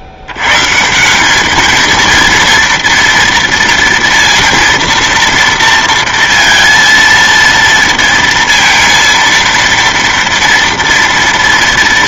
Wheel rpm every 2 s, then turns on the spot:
80, 230, 230, 230, 230, 230.
none